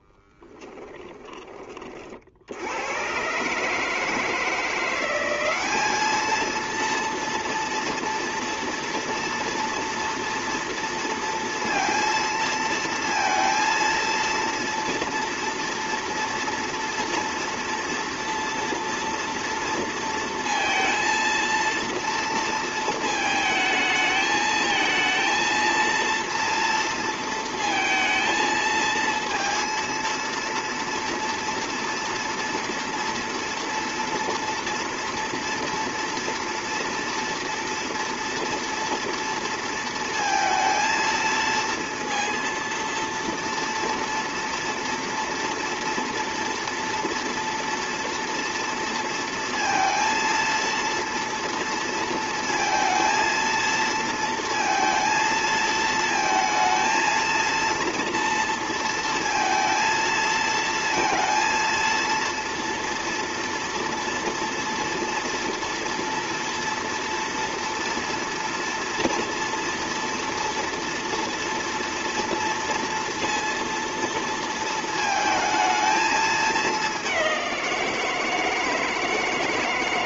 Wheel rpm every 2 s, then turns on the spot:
10, 90, 170, 230, 230, 230, 230, 230, 230, 230, 230, 230, 220, 230, 230, 230, 230, 240, 230, 230, 230, 230, 230, 230, 230, 230, 230, 230, 220, 230, 220, 230, 230, 230, 230, 230, 230, 220, 200, 160.
0-2